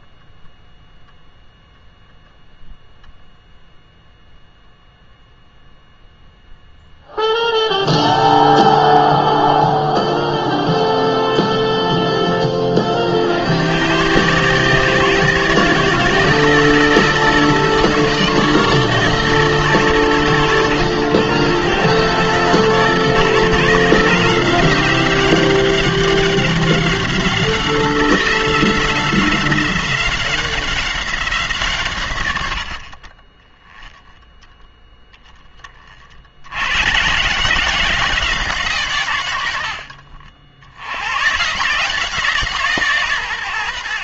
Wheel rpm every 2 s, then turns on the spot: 0, 0, 0, 0, 0, 0, 40, 150, 160, 160, 110, 150, 190, 190, 180, 190, 50, 0, 120, 140, 100, 150.
none